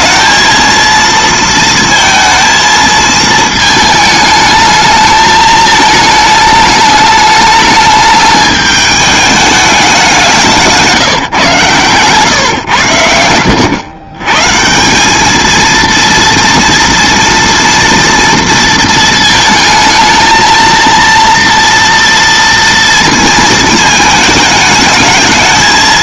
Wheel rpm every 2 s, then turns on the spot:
220, 230, 220, 210, 210, 180, 130, 140, 230, 230, 230, 230, 210.
none